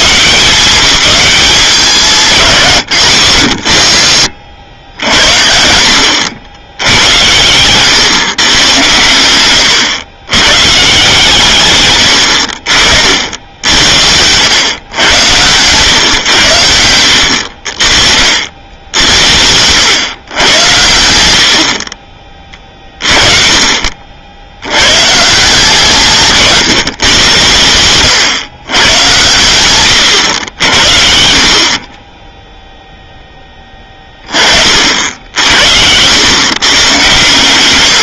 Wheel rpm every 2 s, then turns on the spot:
180, 160, 60, 90, 110, 130, 60, 100, 100, 80, 100, 30, 90, 140, 120, 70, 0, 50, 120.
none